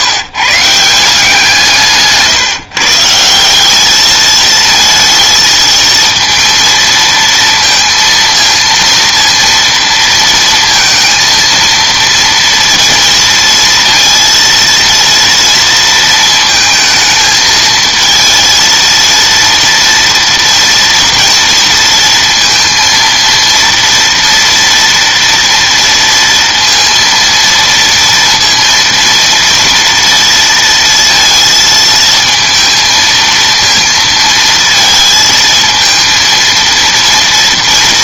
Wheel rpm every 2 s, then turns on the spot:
160, 150, 220, 230, 230, 230, 230, 230, 220, 230, 230, 230, 230, 230, 230, 230, 230, 220, 230.
none